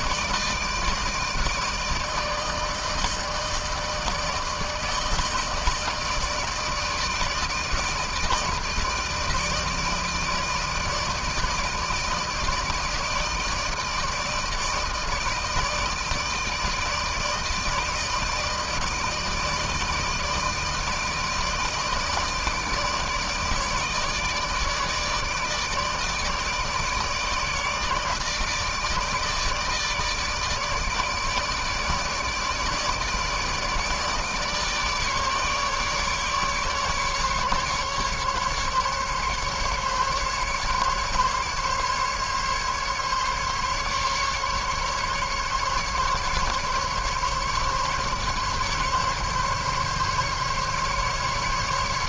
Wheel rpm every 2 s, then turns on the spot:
160, 160, 150, 160, 150, 160, 160, 160, 160, 160, 160, 160, 150, 150, 160, 160, 160, 150, 150, 150, 140, 140, 140, 140, 140, 140.
none